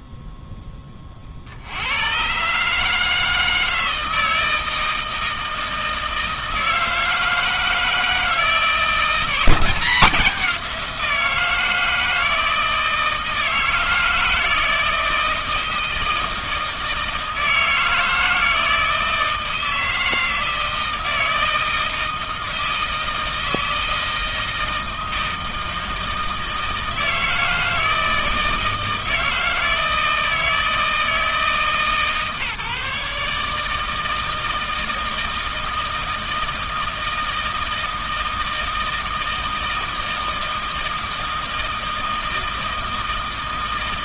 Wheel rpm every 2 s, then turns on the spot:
0, 80, 160, 160, 160, 190, 160, 160, 160, 160, 160, 160, 160, 160, 160, 160, 140, 160, 160, 160, 160, 160.
none